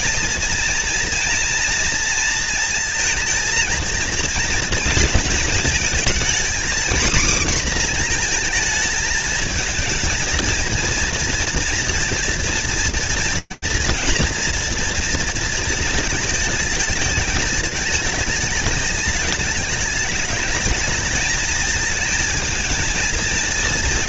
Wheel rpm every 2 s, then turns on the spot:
230, 230, 230, 230, 230, 230, 240, 230, 220, 220, 210, 220.
none